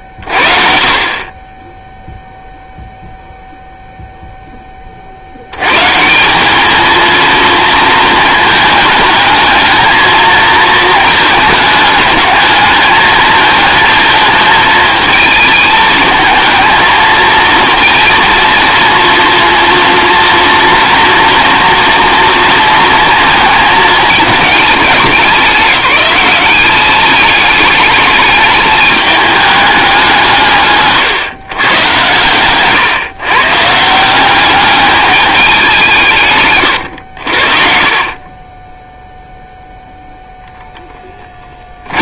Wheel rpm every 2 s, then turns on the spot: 30, 0, 20, 220, 220, 220, 210, 220, 220, 230, 240, 230, 200, 200, 210, 140, 130, 200, 150, 40, 10.
38-40